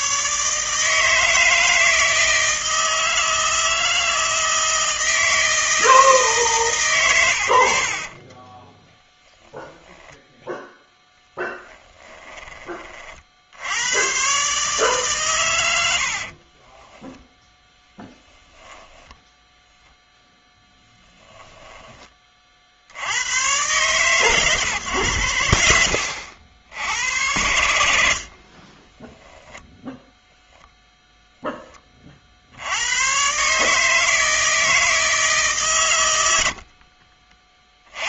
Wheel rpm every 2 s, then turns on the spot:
150, 160, 160, 150, 30, 10, 30, 130, 40, 0, 10, 40, 120, 80, 30, 0, 90, 160, 60.
8-10 16-18 28-30 36-38